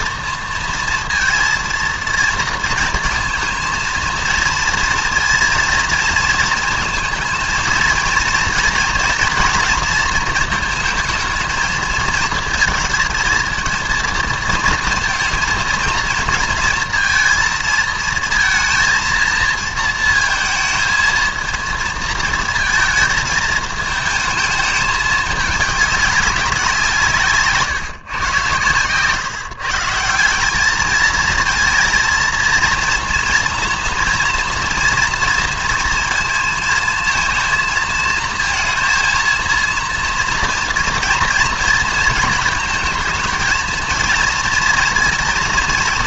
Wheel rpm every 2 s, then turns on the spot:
230, 220, 230, 220, 230, 230, 230, 230, 230, 230, 220, 220, 220, 180, 120, 200, 230, 230, 230, 230, 230, 230, 230.
none